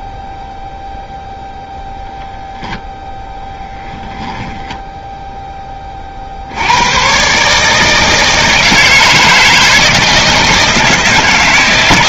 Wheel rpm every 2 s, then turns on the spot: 0, 0, 10, 90, 160, 160.
none